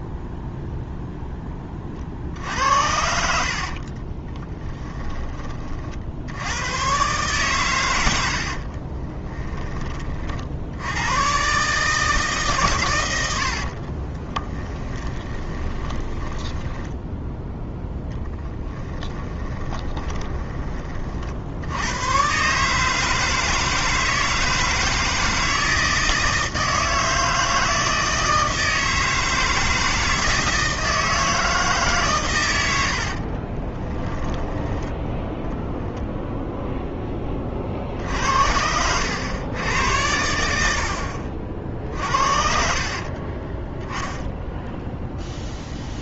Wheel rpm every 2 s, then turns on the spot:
0, 70, 10, 110, 50, 70, 120, 10, 10, 10, 30, 150, 160, 160, 160, 160, 90, 10, 0, 80, 70, 50, 0.
2-6 8-10 14-20 42-44